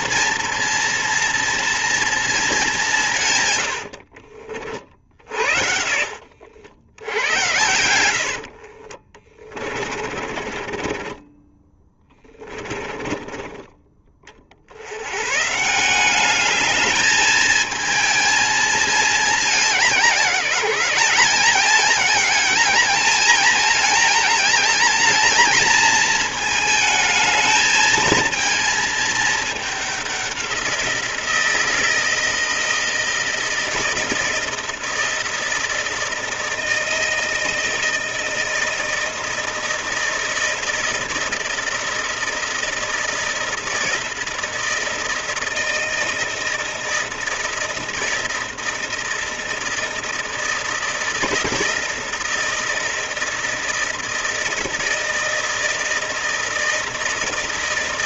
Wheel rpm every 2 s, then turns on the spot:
230, 200, 50, 70, 50, 30, 20, 70, 210, 220, 180, 220, 220, 220, 220, 180, 160, 160, 160, 160, 160, 160, 160, 160, 160, 160, 160, 160, 160.
8-14